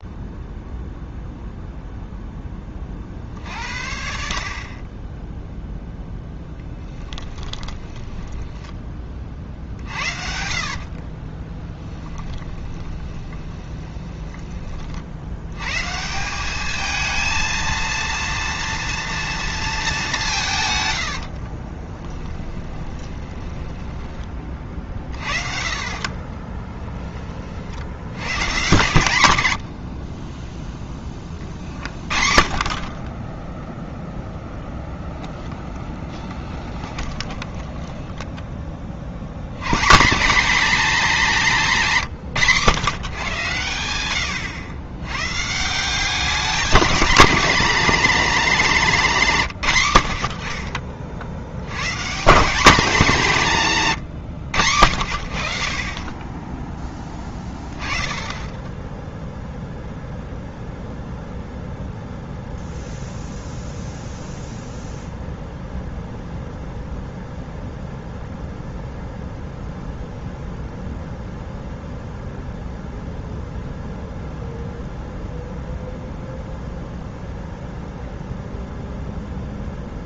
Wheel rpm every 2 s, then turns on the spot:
0, 20, 40, 10, 10, 70, 20, 20, 210, 230, 120, 10, 40, 20, 120, 10, 40, 10, 20, 30, 240, 150, 100, 210, 200, 40, 210, 80, 10, 10, 0, 0, 0, 0, 0, 0, 0, 0, 0, 0.
8-14 20-24 26-28 30-32 36-38